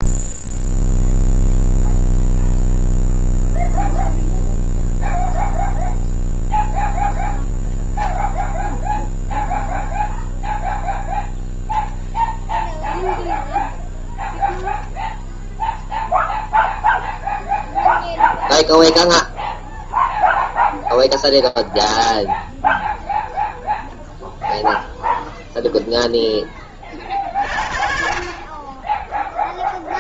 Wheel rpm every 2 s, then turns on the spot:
0, 0, 0, 0, 0, 0, 0, 0, 0, 0, 0, 0, 0, 30, 10.
none